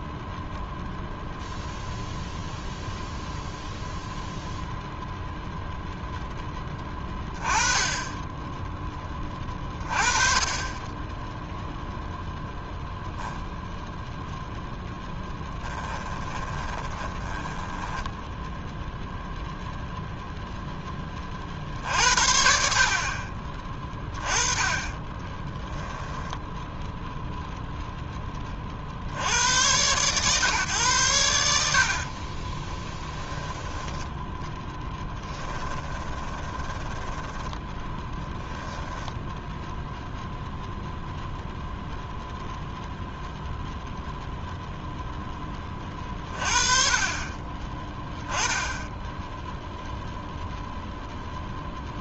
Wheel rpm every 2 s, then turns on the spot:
0, 0, 0, 20, 30, 0, 0, 20, 10, 0, 60, 20, 10, 0, 100, 70, 10, 10, 10, 0, 0, 0, 10, 30, 10, 0.
14-18 24-26 34-38